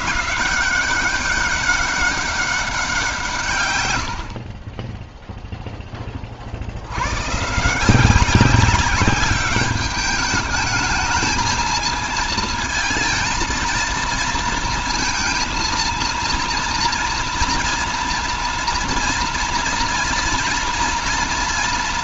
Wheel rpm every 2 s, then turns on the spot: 180, 180, 10, 80, 200, 220, 230, 230, 230, 230, 230.
none